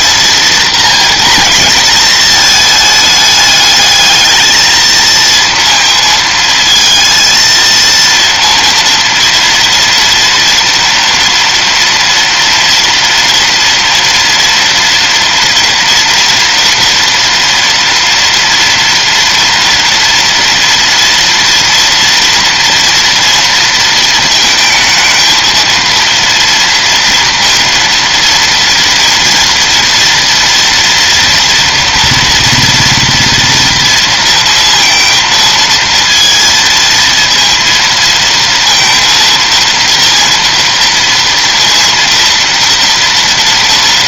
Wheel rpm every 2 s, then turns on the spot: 230, 220, 220, 220, 230, 230, 230, 230, 230, 230, 230, 230, 220, 230, 230, 230, 240, 230, 230, 230, 230, 230.
none